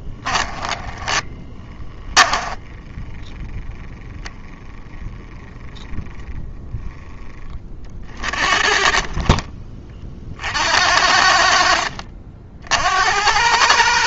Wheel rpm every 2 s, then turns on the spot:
10, 10, 10, 10, 40, 60, 60.
0-4